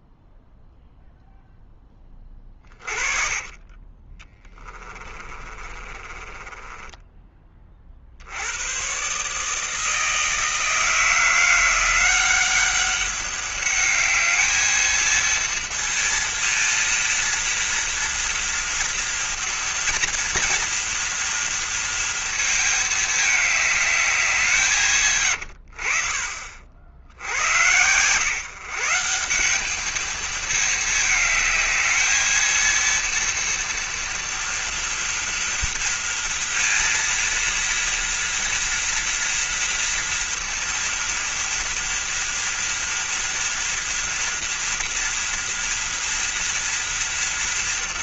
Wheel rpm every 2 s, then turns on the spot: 0, 30, 20, 20, 110, 160, 190, 220, 230, 230, 230, 220, 160, 60, 150, 220, 230, 230, 230, 230, 230, 230, 240, 230.
2-8